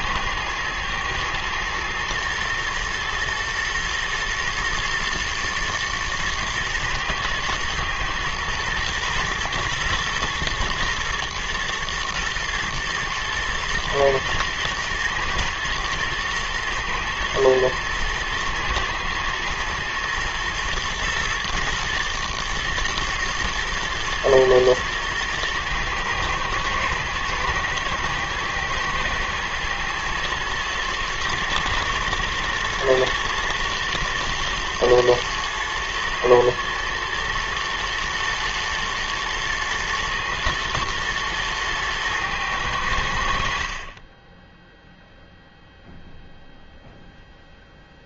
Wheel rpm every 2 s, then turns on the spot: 120, 120, 120, 110, 110, 110, 110, 110, 110, 110, 110, 110, 110, 110, 110, 110, 120, 120, 120, 110, 120, 100, 0, 0.
none